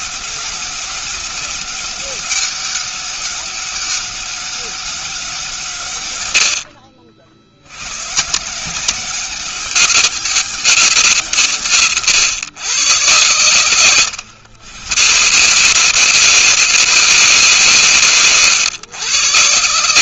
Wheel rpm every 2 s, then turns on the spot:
200, 200, 190, 60, 180, 170, 110, 120, 160, 100.
none